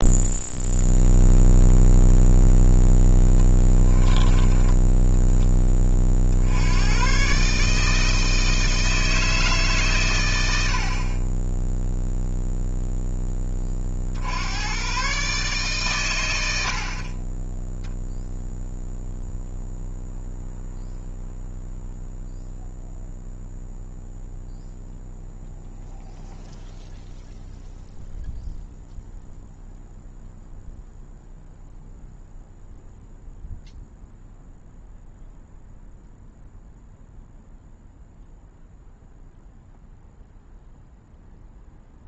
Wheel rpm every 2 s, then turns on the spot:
0, 0, 10, 100, 160, 50, 0, 120, 50, 0, 0, 0, 0, 0, 0, 0, 0, 0, 0, 0, 0.
none